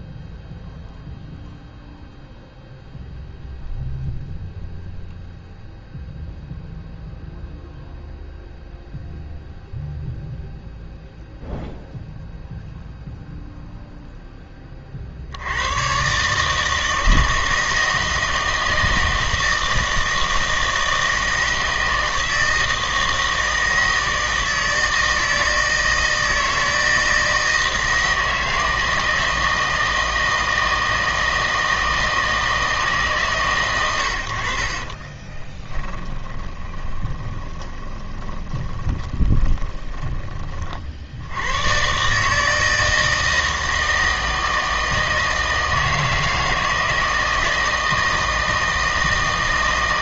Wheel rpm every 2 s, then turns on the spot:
0, 0, 0, 0, 0, 0, 0, 20, 150, 160, 160, 160, 160, 160, 160, 160, 160, 50, 20, 20, 40, 160, 160, 160, 160.
36-40